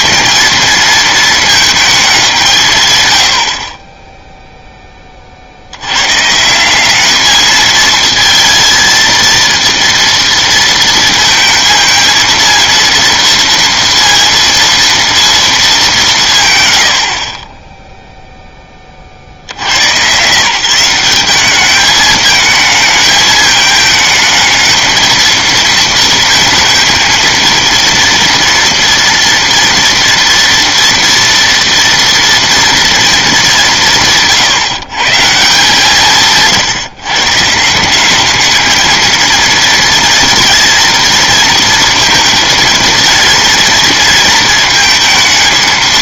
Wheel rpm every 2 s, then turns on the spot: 220, 150, 0, 170, 230, 230, 230, 230, 120, 10, 160, 220, 220, 230, 230, 230, 230, 150, 150, 210, 230, 230, 220.
none